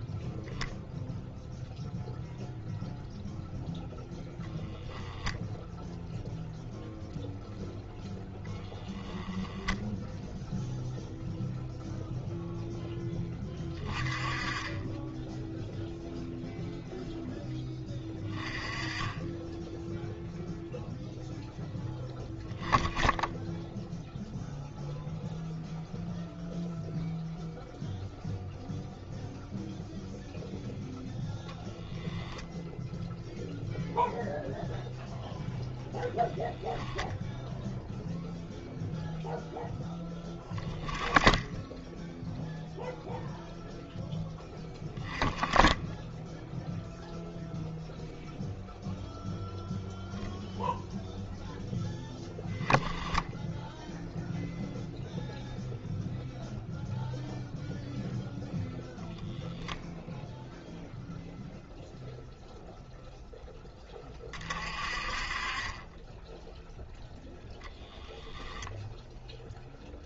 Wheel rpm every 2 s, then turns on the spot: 0, 0, 0, 0, 0, 0, 10, 20, 0, 20, 0, 10, 0, 0, 0, 0, 0, 0, 0, 0, 10, 0, 10, 0, 0, 0, 10, 0, 0, 0, 0, 0, 30, 0, 0.
none